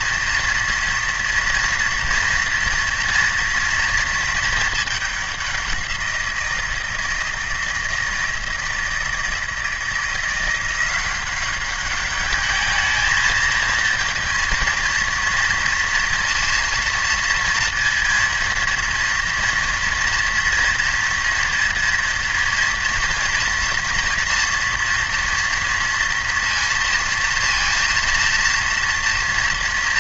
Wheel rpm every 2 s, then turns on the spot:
230, 230, 210, 170, 160, 180, 220, 230, 230, 230, 230, 230, 240, 230, 230.
none